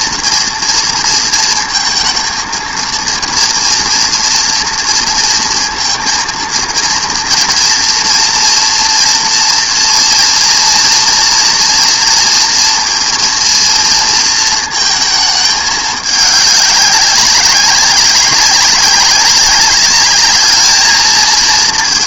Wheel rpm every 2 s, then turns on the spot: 230, 230, 230, 230, 230, 230, 230, 220, 200, 200, 210.
none